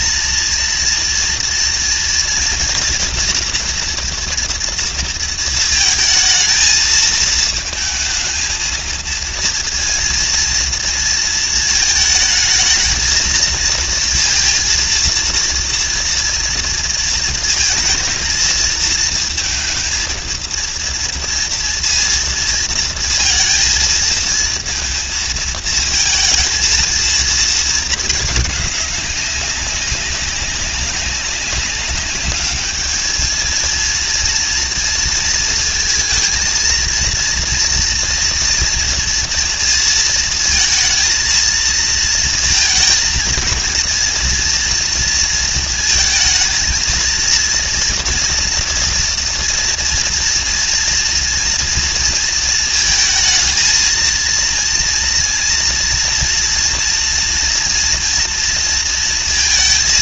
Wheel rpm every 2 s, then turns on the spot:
230, 230, 230, 220, 230, 230, 220, 230, 220, 220, 230, 230, 230, 230, 200, 190, 220, 230, 230, 230, 230, 230, 230, 230, 230, 230, 220, 230, 240, 230.
none